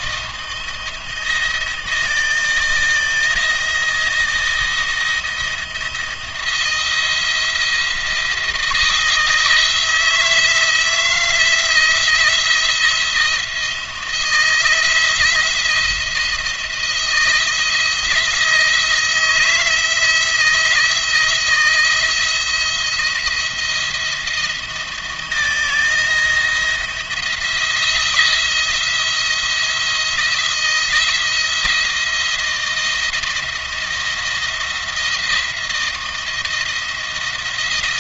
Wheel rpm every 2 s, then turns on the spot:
170, 160, 170, 170, 170, 170, 160, 170, 170, 160, 160, 170, 170, 170, 160, 170, 160, 160, 170.
none